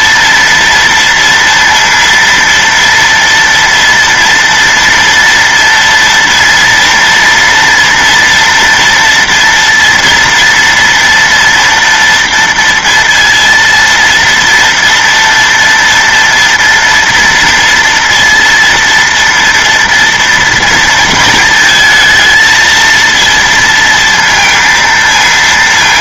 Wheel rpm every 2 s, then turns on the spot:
230, 230, 230, 230, 230, 230, 230, 230, 240, 230, 230, 230, 230.
none